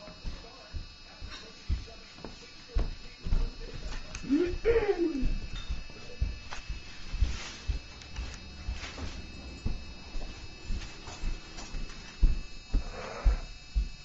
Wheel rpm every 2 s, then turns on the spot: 0, 0, 0, 0, 0, 0, 0.
none